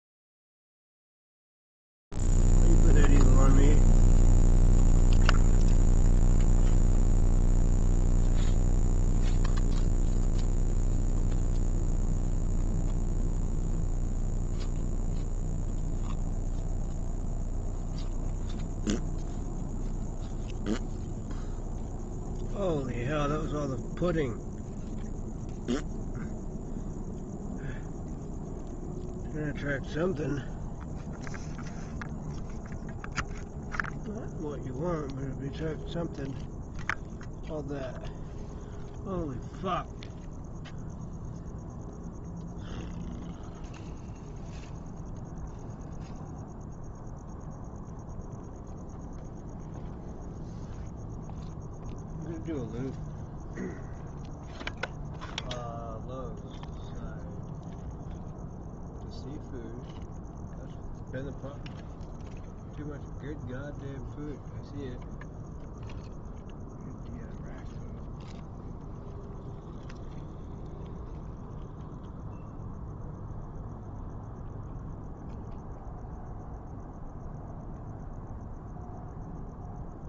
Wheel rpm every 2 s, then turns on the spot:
0, 0, 0, 0, 0, 0, 0, 0, 0, 0, 0, 0, 0, 0, 0, 0, 0, 0, 0, 0, 0, 0, 0, 0, 0, 0, 0, 0, 0, 0, 0, 0, 0, 0, 0, 0, 0, 0, 0, 0.
none